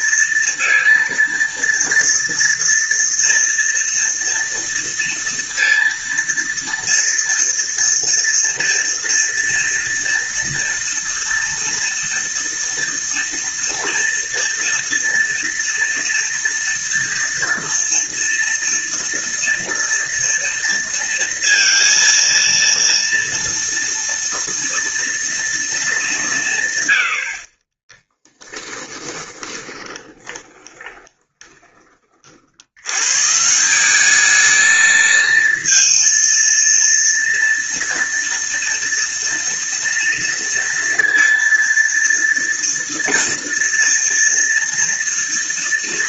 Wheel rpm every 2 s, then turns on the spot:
230, 230, 230, 230, 230, 230, 230, 230, 240, 230, 230, 230, 230, 60, 20, 20, 150, 230, 230, 230, 230, 230, 230.
28-32